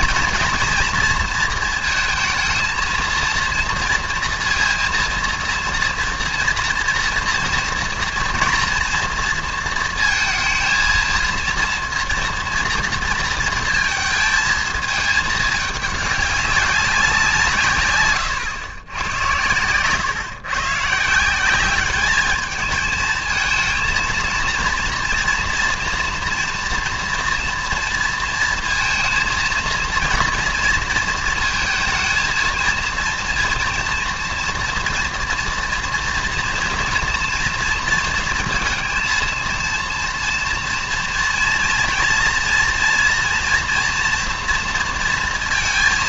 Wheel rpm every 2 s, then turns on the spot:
230, 230, 230, 230, 230, 230, 230, 220, 200, 110, 140, 210, 230, 230, 230, 230, 230, 230, 230, 230, 230, 230, 230.
none